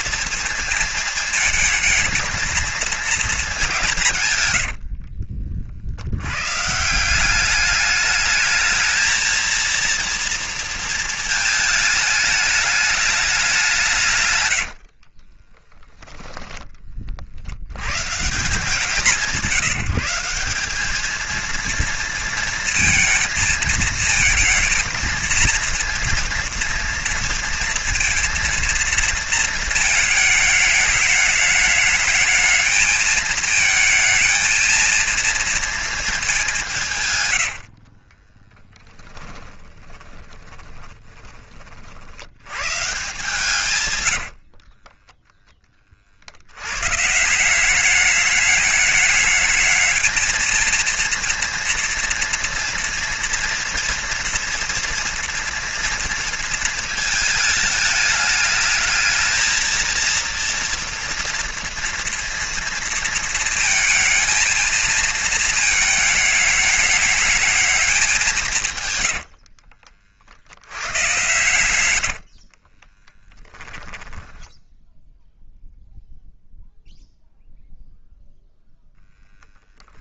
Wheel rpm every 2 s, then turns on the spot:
220, 220, 90, 150, 220, 230, 210, 90, 20, 180, 200, 230, 220, 230, 230, 210, 220, 230, 160, 10, 20, 140, 30, 120, 210, 230, 230, 230, 230, 220, 230, 230, 230, 210, 130, 90, 30, 10, 0, 0.
4-6 14-16 38-42 44-46 72-74